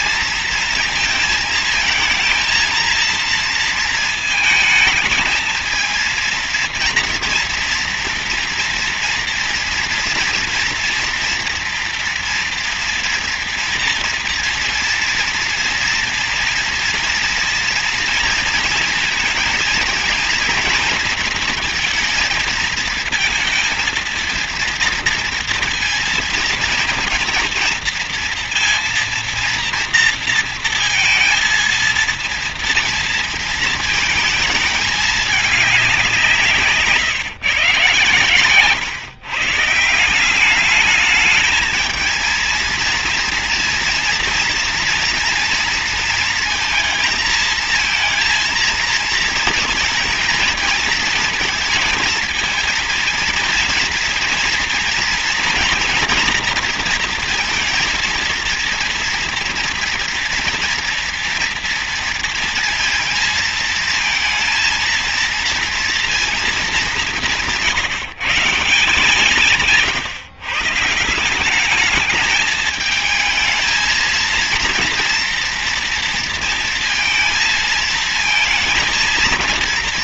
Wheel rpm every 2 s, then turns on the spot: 230, 230, 220, 230, 230, 230, 230, 230, 240, 230, 230, 220, 230, 230, 230, 230, 230, 220, 150, 120, 200, 230, 230, 230, 230, 230, 230, 230, 230, 230, 230, 230, 230, 220, 160, 150, 220, 230, 230, 220.
none